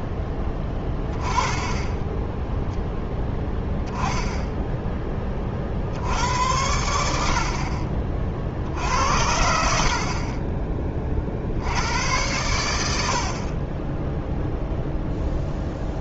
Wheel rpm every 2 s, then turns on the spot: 20, 0, 10, 130, 50, 40, 100, 0.
none